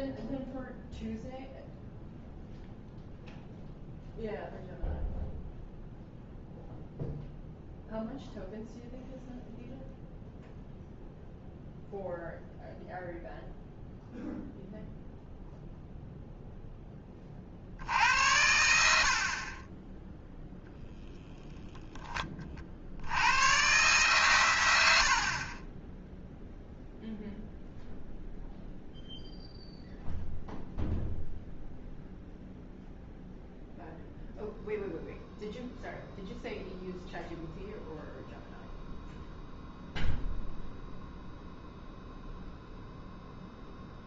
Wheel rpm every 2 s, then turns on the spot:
0, 0, 0, 0, 0, 0, 0, 0, 10, 70, 0, 40, 100, 0, 0, 0, 0, 0, 0, 0, 0, 0.
none